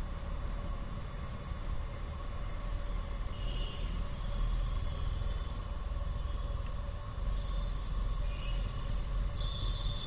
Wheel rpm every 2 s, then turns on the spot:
0, 0, 0, 0, 0.
none